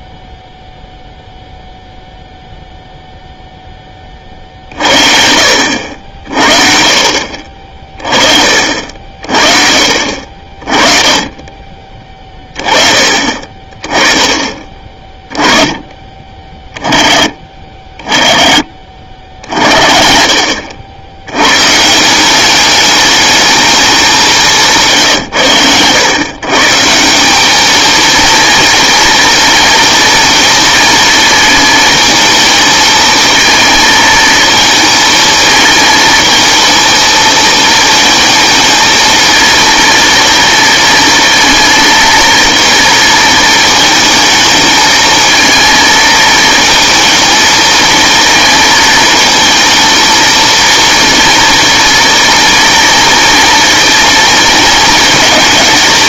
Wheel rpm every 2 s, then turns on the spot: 0, 0, 30, 70, 40, 50, 20, 20, 30, 50, 90, 210, 140, 170, 240, 230, 220, 220, 230, 220, 230, 230, 220, 220, 220, 230, 230, 230.
24-26